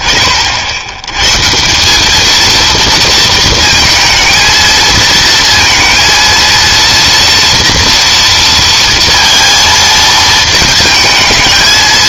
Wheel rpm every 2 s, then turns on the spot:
20, 210, 220, 230, 230, 230.
none